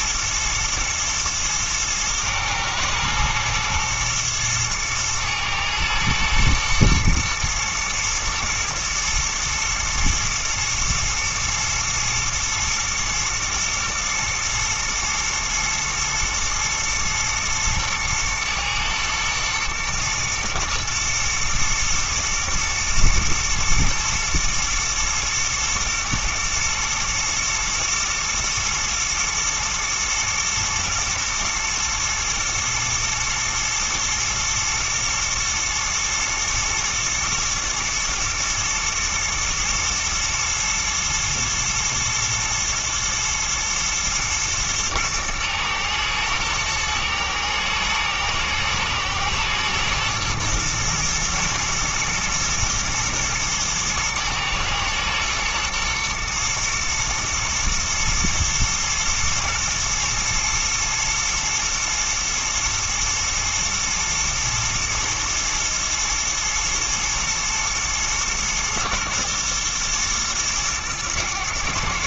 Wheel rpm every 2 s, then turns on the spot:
110, 110, 110, 110, 110, 110, 110, 110, 110, 110, 110, 110, 110, 120, 120, 110, 110, 120, 120, 110, 110, 110, 110, 110, 110, 110, 110, 110, 110, 110, 110, 110, 110, 110, 120, 110.
none